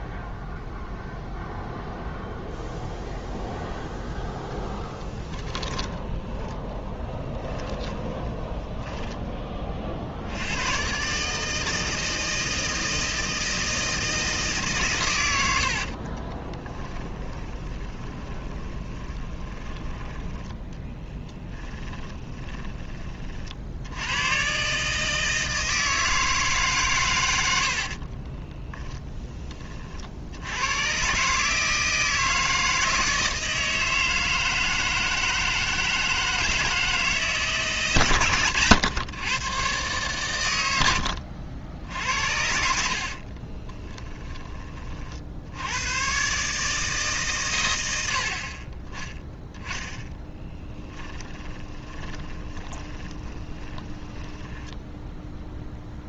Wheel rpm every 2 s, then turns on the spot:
0, 0, 10, 10, 10, 110, 160, 130, 10, 20, 10, 20, 140, 130, 10, 120, 160, 160, 160, 120, 80, 70, 30, 150, 20, 10, 10, 0.
4-10 16-22 42-44 50-54